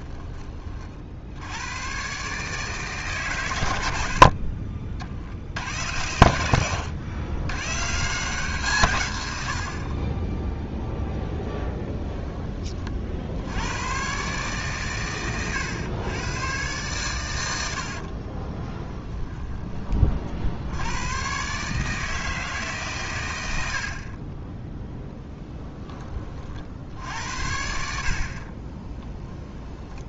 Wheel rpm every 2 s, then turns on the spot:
50, 140, 50, 100, 130, 0, 30, 130, 120, 10, 90, 140, 0, 60, 20.
18-20 28-30